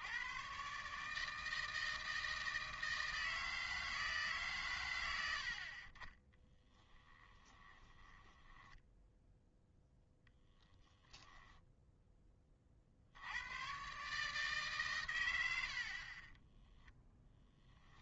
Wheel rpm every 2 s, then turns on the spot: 70, 160, 160, 50, 10, 0, 20, 120, 0.
8-10